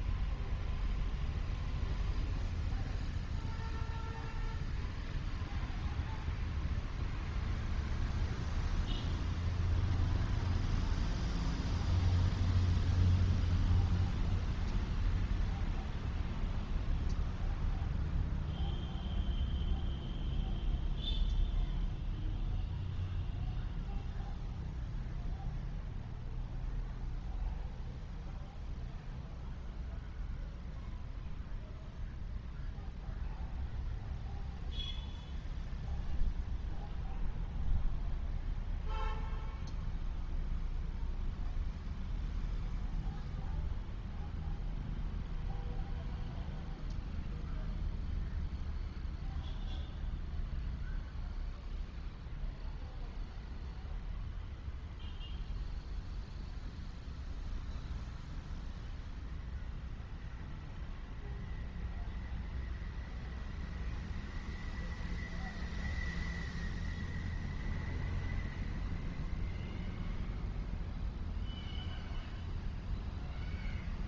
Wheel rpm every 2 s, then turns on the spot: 0, 0, 0, 0, 0, 0, 0, 0, 0, 0, 0, 0, 0, 0, 0, 0, 0, 0, 0, 0, 0, 0, 0, 0, 0, 0, 0, 0, 0, 0, 0, 0, 0, 0, 0, 0, 0.
none